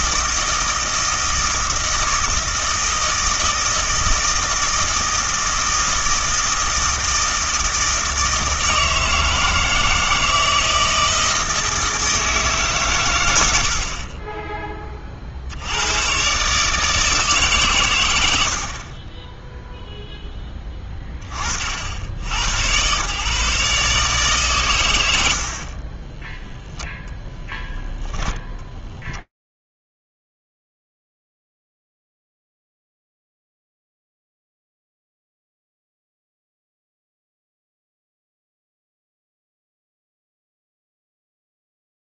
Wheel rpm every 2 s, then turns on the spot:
160, 160, 160, 160, 160, 160, 150, 20, 150, 60, 10, 100, 130, 0, 0, 70, 0, 0, 0, 0, 0.
none